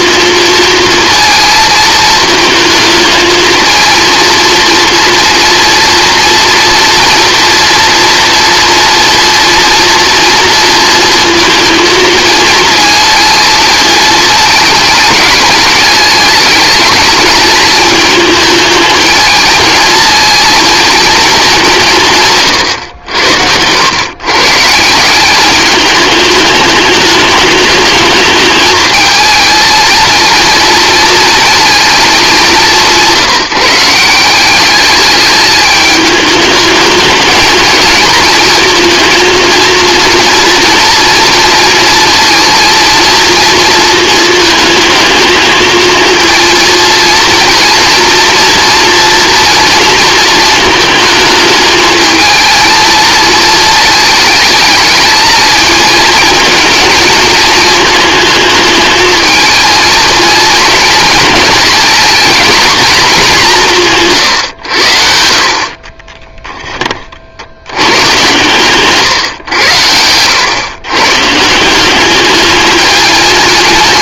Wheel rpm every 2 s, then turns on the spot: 230, 220, 230, 230, 230, 230, 220, 210, 220, 220, 230, 120, 150, 210, 220, 220, 190, 200, 210, 230, 230, 240, 220, 230, 230, 220, 220, 220, 230, 220, 230, 230, 100, 10, 130, 120, 210.
none